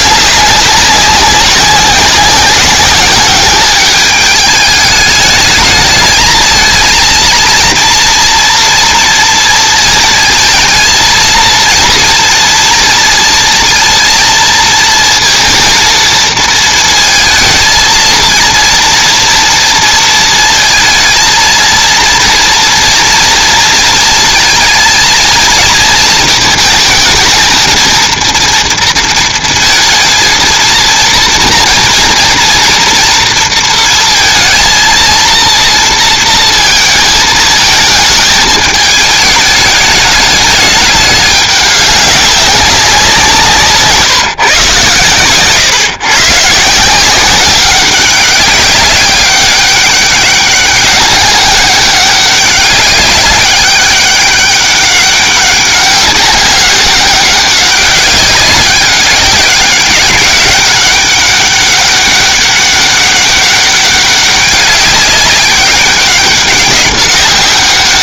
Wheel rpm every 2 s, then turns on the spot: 190, 200, 220, 230, 230, 230, 230, 230, 230, 230, 220, 230, 230, 230, 230, 230, 230, 230, 220, 210, 210, 180, 130, 180, 200, 200, 200, 200, 190, 200, 200, 200, 200, 200.
none